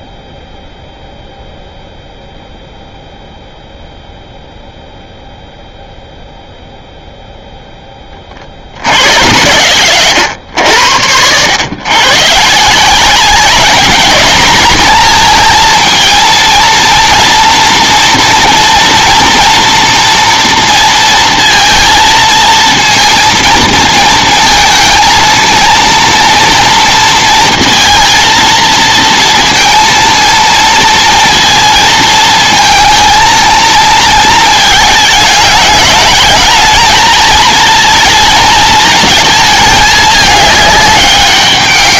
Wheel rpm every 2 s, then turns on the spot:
0, 0, 0, 0, 80, 90, 190, 220, 230, 240, 230, 230, 220, 230, 230, 230, 220, 210, 220, 220, 200.
10-12